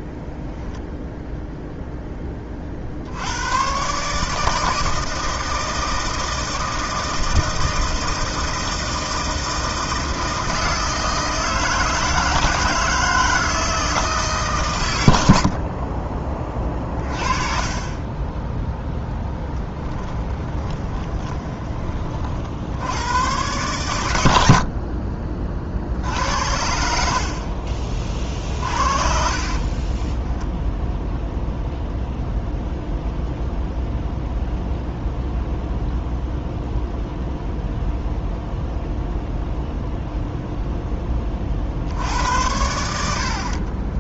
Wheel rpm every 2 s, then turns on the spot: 0, 50, 160, 160, 160, 160, 160, 110, 30, 10, 20, 80, 50, 70, 50, 10, 0, 0, 0, 0, 0, 90.
20-22 24-26 28-30